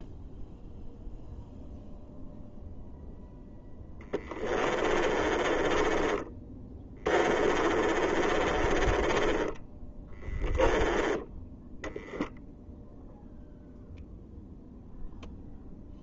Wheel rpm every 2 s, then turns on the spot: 0, 0, 20, 20, 20, 10, 0, 0.
4-10